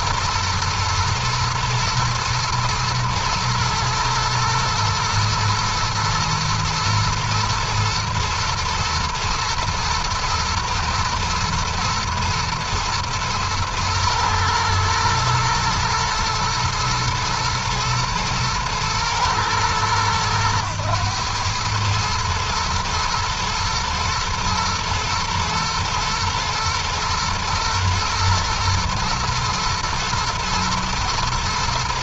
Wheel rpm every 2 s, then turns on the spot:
110, 120, 110, 120, 110, 120, 120, 110, 120, 110, 100, 120, 110, 120, 120, 120.
none